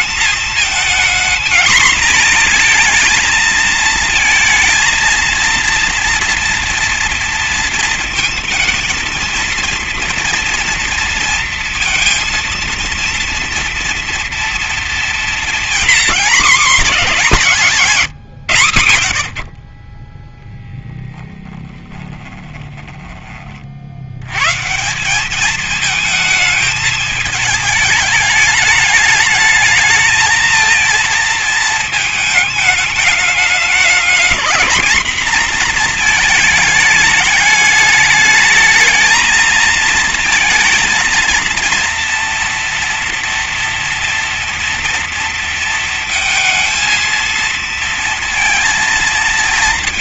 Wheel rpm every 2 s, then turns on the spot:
230, 230, 230, 230, 220, 230, 230, 230, 200, 100, 10, 20, 190, 220, 210, 230, 210, 230, 210, 220, 230, 230, 230, 220, 230.
none